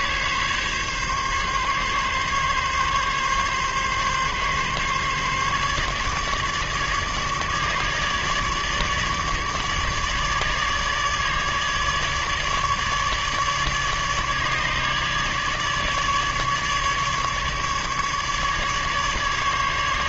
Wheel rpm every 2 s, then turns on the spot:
140, 140, 140, 150, 150, 150, 150, 150, 150, 150.
none